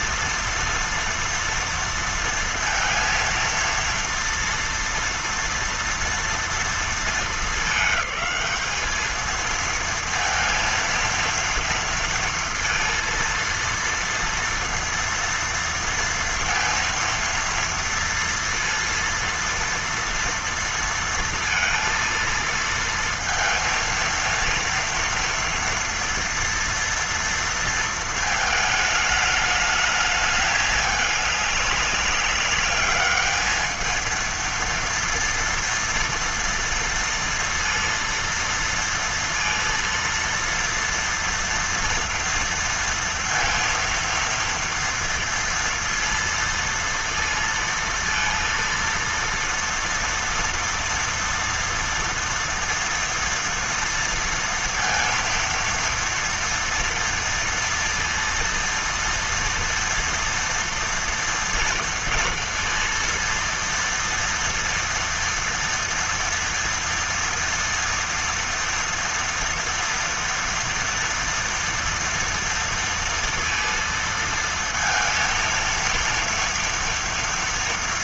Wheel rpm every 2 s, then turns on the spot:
230, 230, 230, 230, 210, 230, 230, 230, 230, 230, 230, 230, 230, 230, 220, 210, 200, 230, 230, 230, 230, 230, 230, 230, 230, 230, 230, 230, 230, 230, 230, 230, 230, 230, 230, 230, 230, 230, 230.
none